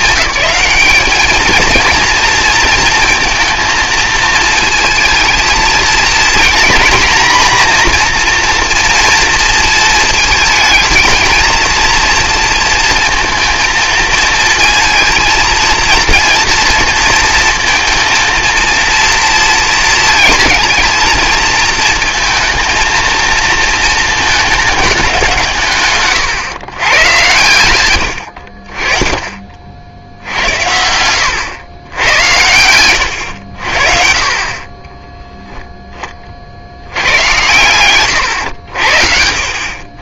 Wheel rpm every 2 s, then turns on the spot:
210, 230, 220, 230, 230, 220, 230, 230, 230, 230, 230, 230, 210, 120, 40, 90, 90, 30, 70, 80.
30-32